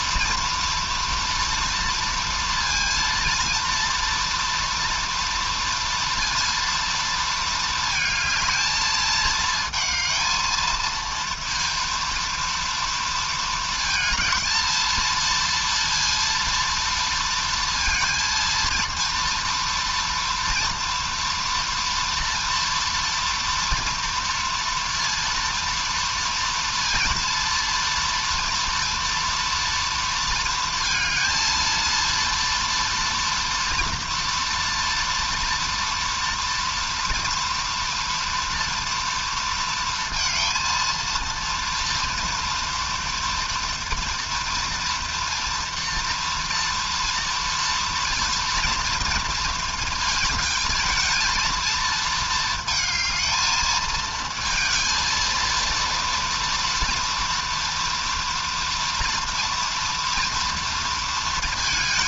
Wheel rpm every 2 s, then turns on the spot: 230, 230, 230, 230, 220, 220, 230, 220, 230, 230, 230, 230, 230, 230, 230, 230, 230, 230, 230, 230, 230, 230, 240, 230, 230, 220, 220, 230, 240, 230, 230.
none